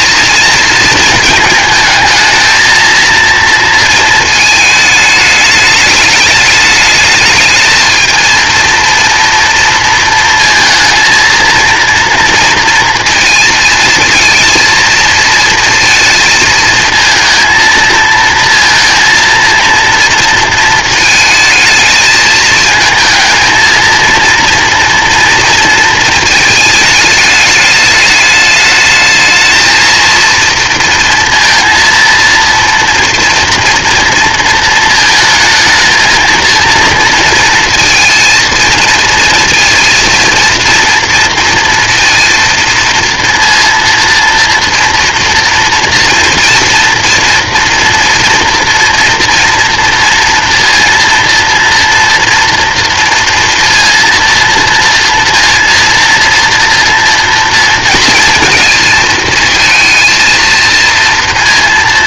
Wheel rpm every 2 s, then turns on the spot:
230, 220, 220, 210, 230, 230, 230, 230, 220, 230, 220, 220, 230, 220, 210, 230, 230, 230, 230, 230, 230, 230, 240, 230, 230, 230, 230, 230, 230, 230, 230.
none